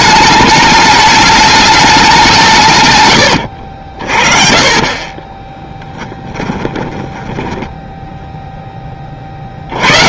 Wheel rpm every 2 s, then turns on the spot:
210, 160, 30, 10, 10.
6-8